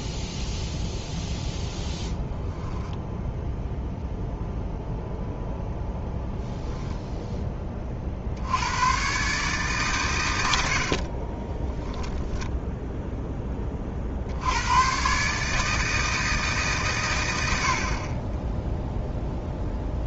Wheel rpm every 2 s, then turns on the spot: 0, 0, 0, 0, 90, 70, 0, 110, 150, 10.
none